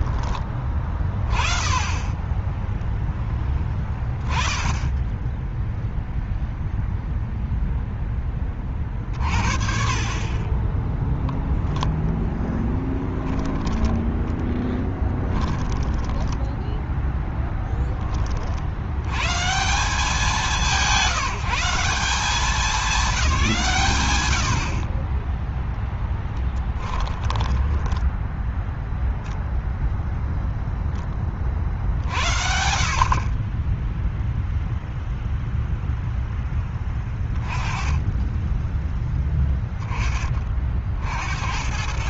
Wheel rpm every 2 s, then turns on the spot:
20, 10, 10, 0, 30, 30, 10, 20, 10, 70, 180, 200, 70, 10, 0, 0, 70, 0, 10, 10, 40.
12-18 26-28